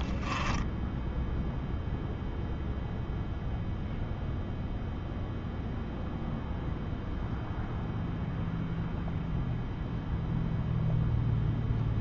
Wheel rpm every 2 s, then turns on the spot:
10, 0, 0, 0, 0, 0.
0-2